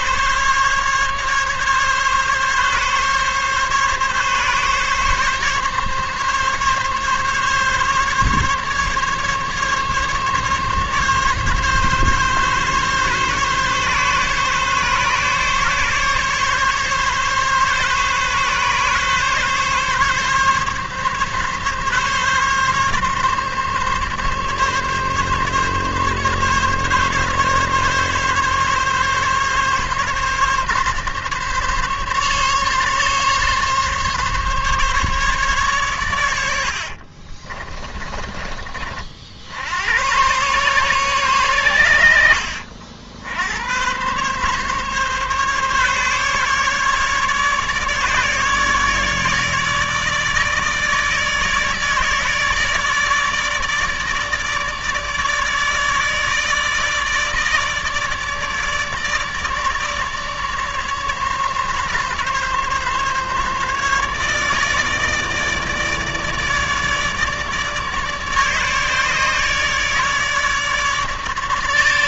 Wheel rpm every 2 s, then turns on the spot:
140, 140, 140, 140, 140, 140, 140, 140, 140, 140, 140, 140, 140, 140, 140, 140, 140, 140, 60, 50, 120, 70, 140, 150, 150, 150, 150, 150, 150, 150, 150, 140, 150, 150, 150, 150.
36-38